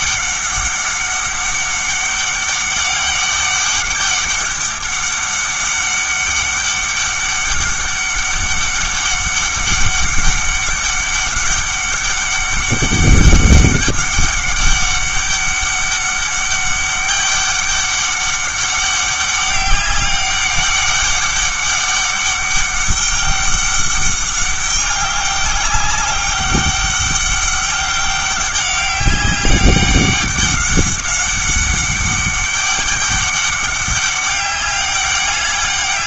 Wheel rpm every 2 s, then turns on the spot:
200, 200, 200, 200, 200, 200, 200, 200, 200, 200, 200, 200, 200, 200, 190, 200, 200, 200.
none